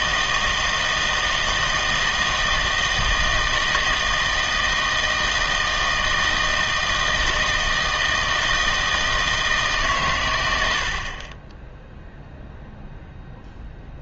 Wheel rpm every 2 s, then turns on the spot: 160, 160, 160, 160, 160, 80, 0.
none